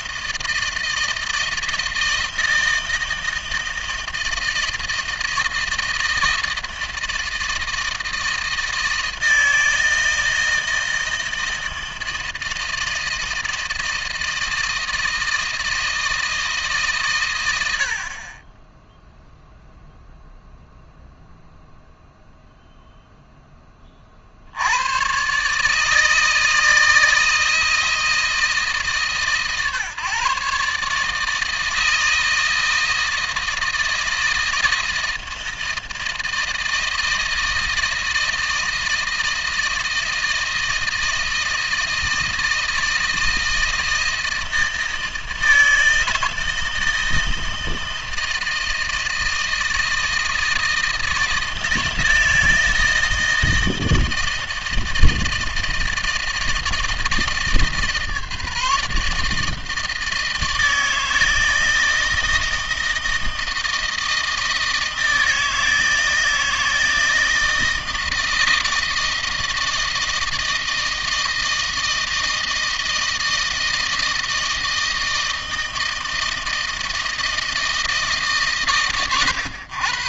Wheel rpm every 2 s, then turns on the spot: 160, 160, 160, 160, 160, 160, 160, 160, 150, 20, 0, 0, 80, 160, 150, 140, 160, 160, 160, 160, 160, 160, 160, 160, 160, 160, 170, 160, 160, 150, 160, 160, 160, 160, 160, 160, 160, 160, 160, 150.
none